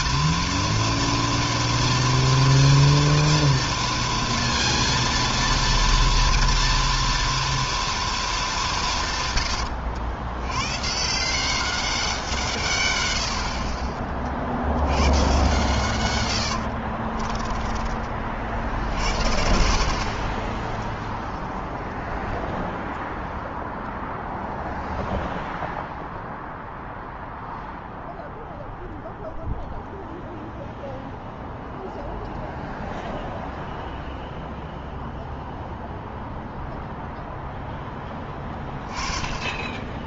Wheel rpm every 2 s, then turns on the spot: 230, 230, 230, 230, 130, 170, 80, 130, 20, 60, 0, 0, 0, 0, 0, 0, 0, 0, 0, 10.
16-18